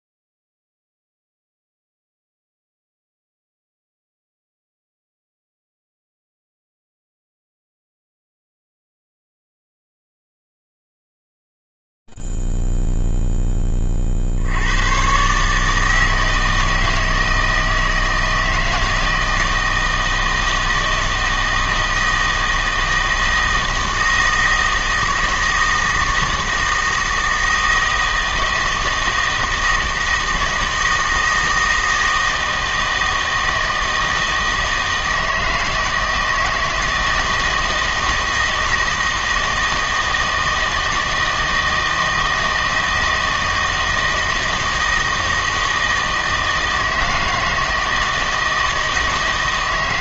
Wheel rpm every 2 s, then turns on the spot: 10, 10, 0, 0, 0, 0, 0, 50, 160, 160, 160, 160, 160, 160, 160, 160, 160, 160, 160, 160, 160, 160, 160, 160, 160.
none